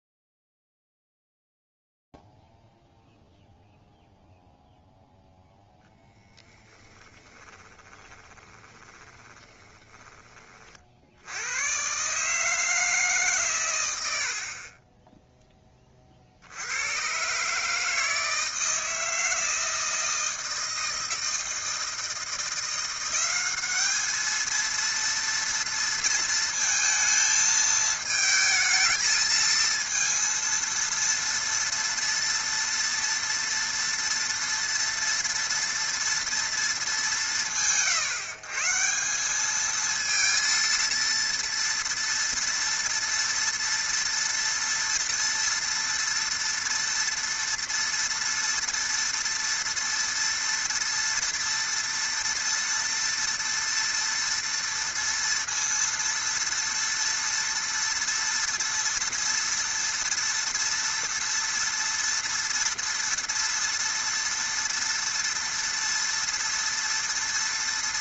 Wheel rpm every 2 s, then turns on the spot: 0, 0, 0, 10, 20, 30, 150, 60, 80, 160, 160, 170, 220, 230, 220, 230, 230, 230, 230, 140, 230, 230, 230, 230, 230, 230, 230, 230, 230, 230, 230, 230, 230, 230.
6-10 14-16